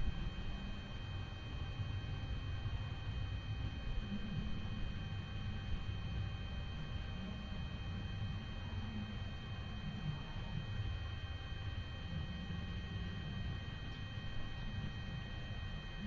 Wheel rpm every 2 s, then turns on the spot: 0, 0, 0, 0, 0, 0, 0, 0.
none